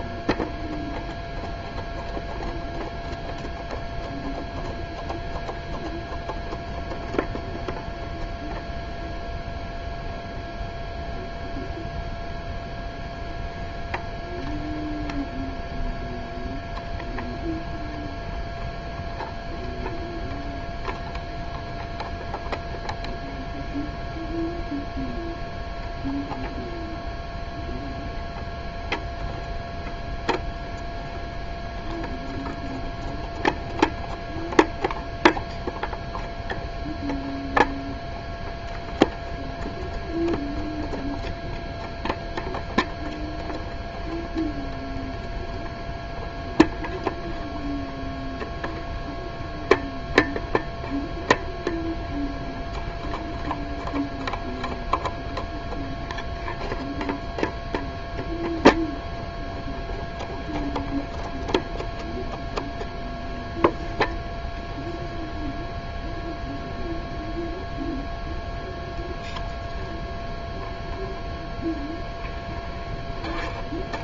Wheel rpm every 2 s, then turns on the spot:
0, 0, 0, 0, 0, 0, 0, 0, 0, 0, 0, 0, 0, 0, 0, 0, 0, 0, 0, 0, 0, 0, 0, 0, 0, 0, 0, 0, 0, 0, 0, 0, 0, 0, 0, 0, 0.
none